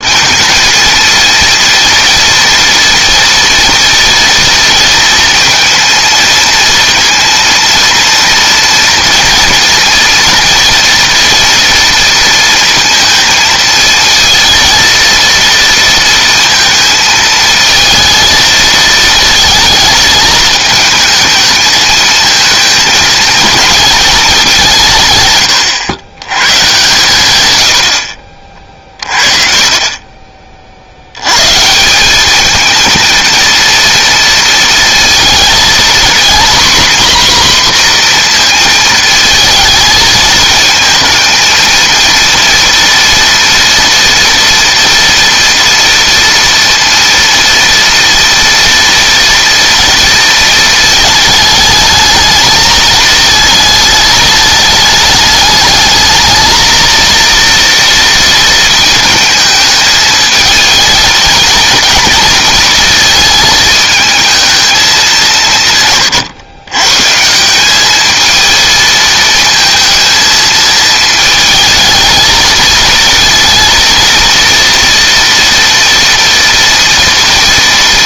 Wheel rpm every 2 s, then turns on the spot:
230, 230, 230, 230, 230, 230, 230, 230, 230, 220, 220, 220, 200, 120, 50, 40, 210, 230, 240, 230, 220, 240, 230, 230, 230, 230, 220, 210, 220, 230, 220, 220, 220, 120, 220, 220, 220, 230, 230.
none